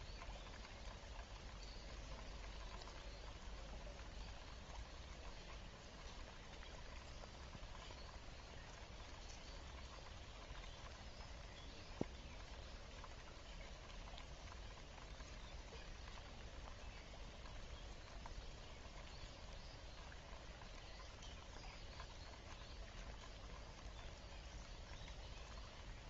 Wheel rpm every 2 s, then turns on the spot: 0, 0, 0, 0, 0, 0, 0, 0, 0, 0, 0, 0, 0.
none